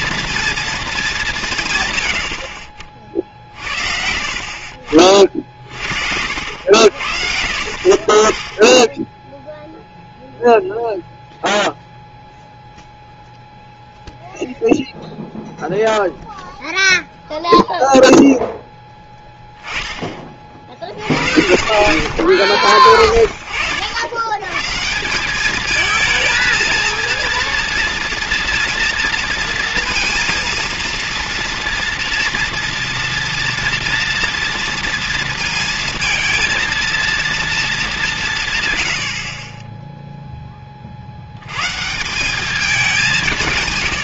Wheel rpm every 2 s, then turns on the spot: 230, 70, 40, 80, 20, 0, 0, 0, 0, 0, 60, 40, 120, 220, 240, 230, 230, 230, 230, 160, 20, 200.
2-4